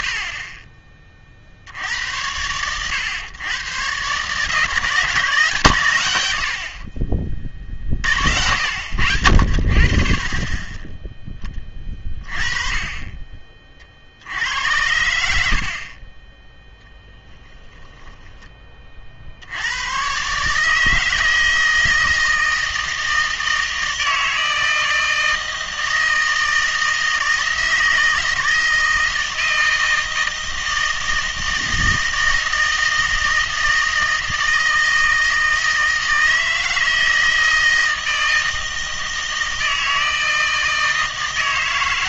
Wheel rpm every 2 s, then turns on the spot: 30, 110, 160, 50, 80, 20, 30, 80, 10, 30, 150, 160, 160, 160, 160, 160, 160, 160, 160, 160, 160.
16-18